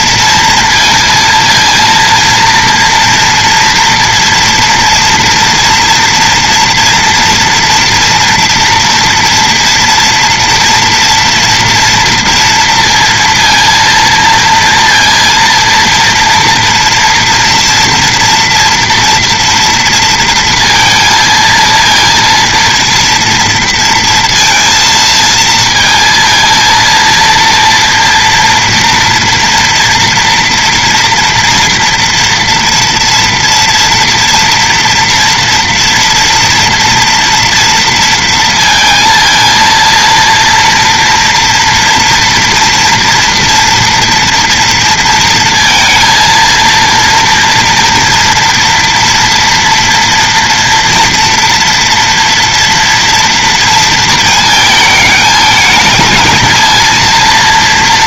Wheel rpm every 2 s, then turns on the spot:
230, 230, 230, 230, 230, 240, 230, 230, 230, 230, 230, 230, 230, 230, 230, 240, 230, 230, 230, 230, 230, 240, 230, 230, 230, 230, 230, 220, 220.
none